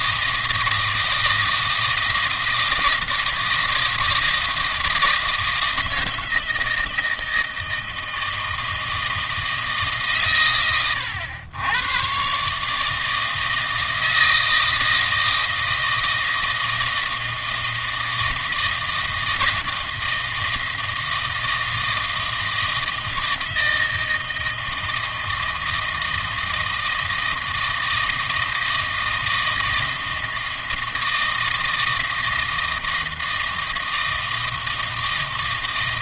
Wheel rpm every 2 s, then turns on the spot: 160, 160, 160, 160, 160, 110, 150, 160, 160, 160, 160, 160, 160, 160, 160, 160, 160, 160.
none